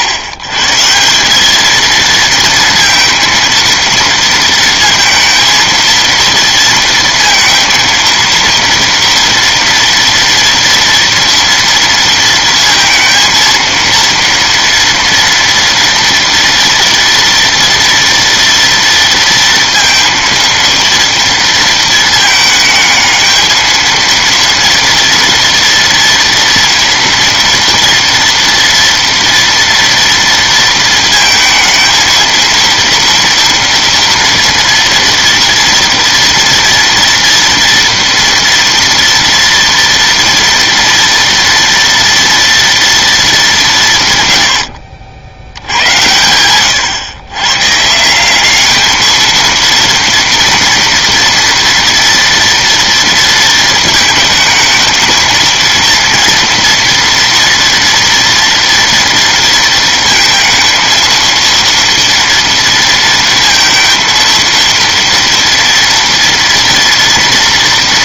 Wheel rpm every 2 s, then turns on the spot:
130, 230, 230, 230, 230, 230, 230, 230, 230, 230, 230, 220, 230, 230, 230, 230, 230, 230, 230, 230, 230, 230, 90, 110, 210, 230, 230, 220, 230, 230, 230, 230, 230, 230.
none